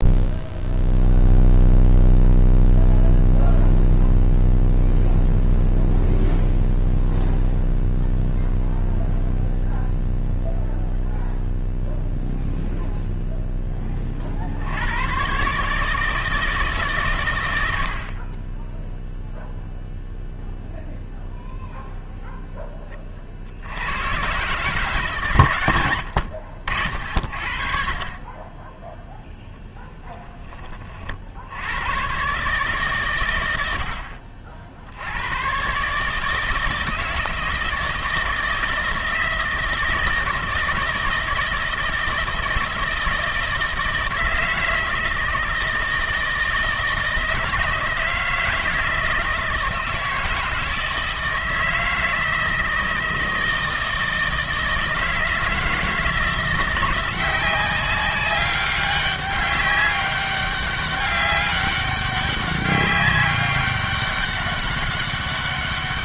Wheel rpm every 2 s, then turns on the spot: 0, 0, 0, 0, 0, 0, 0, 70, 150, 20, 0, 10, 140, 70, 10, 30, 140, 60, 160, 160, 160, 160, 160, 160, 160, 160, 160, 160, 170, 200, 200, 200, 200.
none